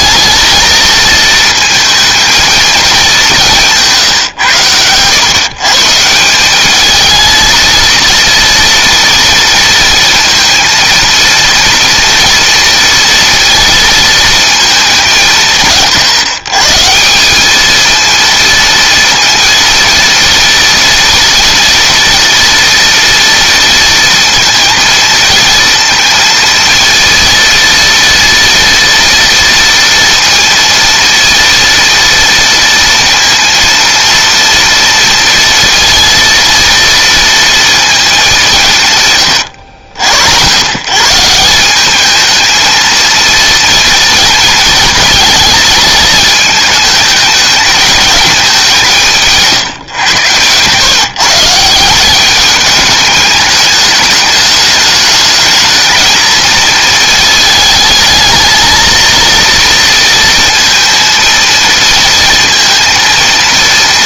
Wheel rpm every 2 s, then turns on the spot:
220, 230, 130, 180, 230, 230, 230, 230, 140, 230, 230, 230, 230, 230, 230, 230, 230, 230, 230, 200, 90, 220, 240, 220, 210, 120, 200, 210, 220, 220, 230, 230.
none